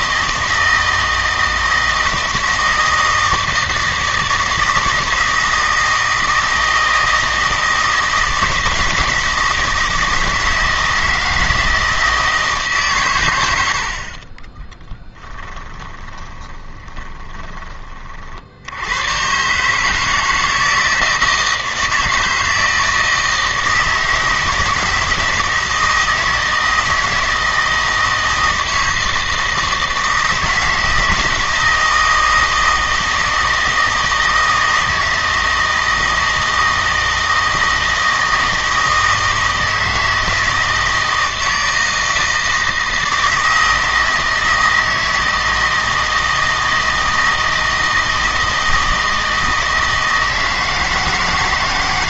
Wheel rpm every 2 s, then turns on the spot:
160, 160, 160, 160, 160, 160, 150, 20, 20, 80, 160, 160, 160, 160, 160, 160, 160, 160, 160, 160, 160, 160, 160, 160, 160, 160.
14-18